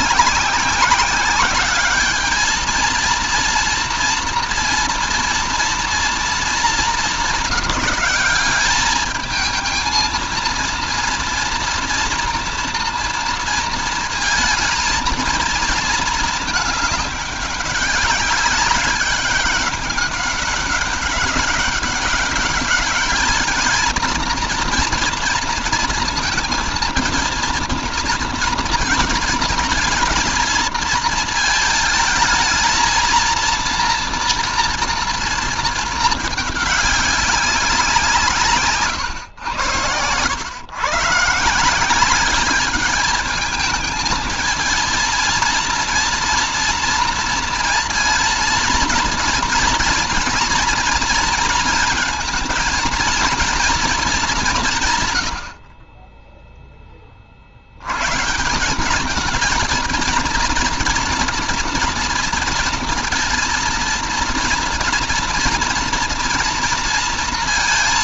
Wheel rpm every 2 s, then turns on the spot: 190, 220, 230, 220, 200, 230, 230, 220, 210, 200, 200, 200, 230, 230, 230, 230, 220, 230, 210, 170, 100, 200, 220, 230, 230, 240, 230, 200, 10, 150, 230, 230, 230, 230.
none